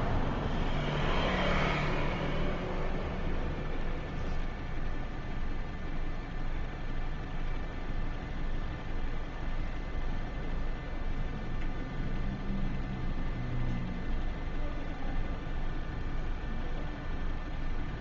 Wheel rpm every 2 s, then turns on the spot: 10, 0, 0, 0, 0, 0, 0, 0, 0.
none